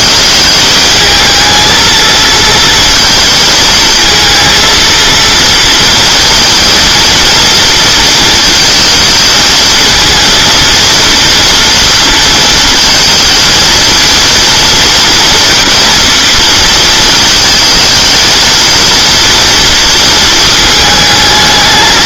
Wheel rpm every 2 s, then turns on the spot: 220, 220, 230, 230, 220, 230, 230, 230, 230, 220, 220.
none